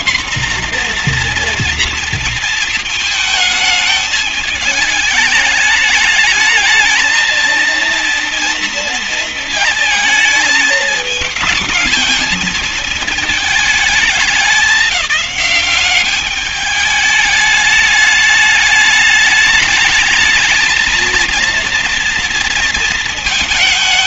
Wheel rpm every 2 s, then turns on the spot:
250, 230, 210, 210, 230, 210, 220, 210, 210, 210, 220, 230.
none